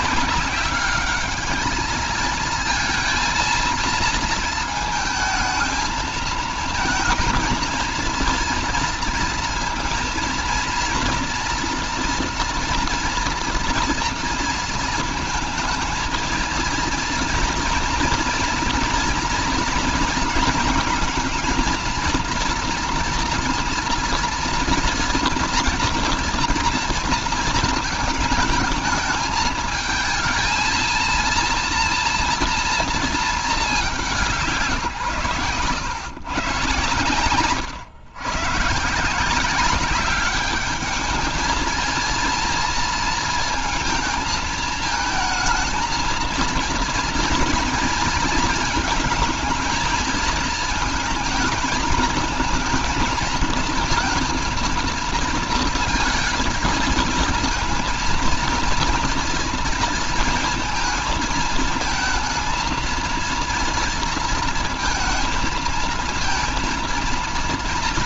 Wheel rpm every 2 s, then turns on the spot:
200, 230, 220, 220, 230, 230, 230, 230, 230, 230, 220, 230, 230, 230, 220, 230, 230, 140, 120, 150, 210, 230, 220, 230, 220, 220, 230, 230, 230, 230, 220, 230, 220, 230.
none